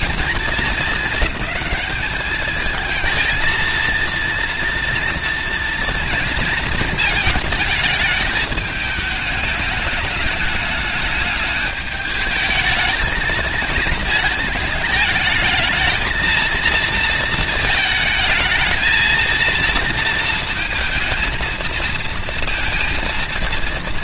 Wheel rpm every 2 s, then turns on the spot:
210, 230, 230, 230, 210, 210, 220, 220, 220, 230, 230, 220.
none